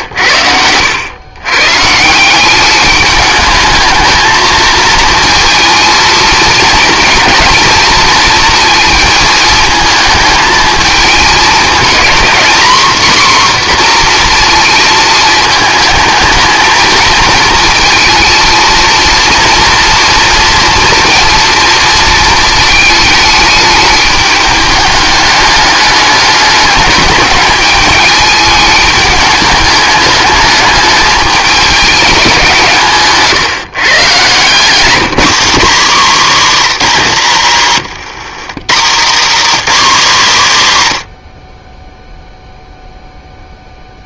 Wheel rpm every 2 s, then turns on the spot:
90, 200, 230, 230, 220, 220, 240, 230, 220, 230, 240, 220, 210, 210, 210, 210, 170, 150, 120, 100, 80, 0.
34-36